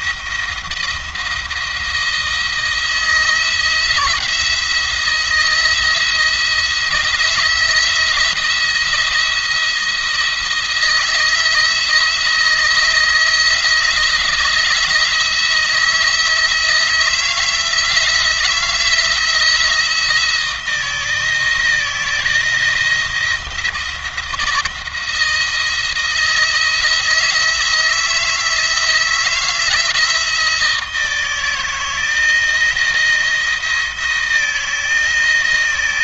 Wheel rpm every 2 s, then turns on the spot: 170, 160, 170, 170, 170, 160, 160, 170, 160, 170, 160, 160, 170, 170, 160, 160, 160, 160.
none